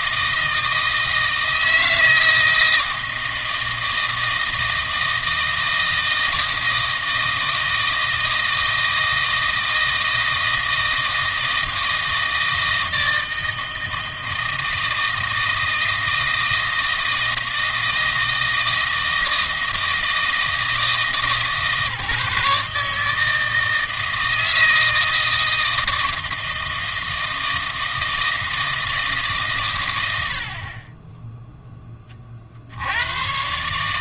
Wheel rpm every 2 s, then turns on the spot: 160, 160, 160, 160, 160, 160, 160, 160, 160, 160, 160, 150, 160, 160, 160, 30, 80.
none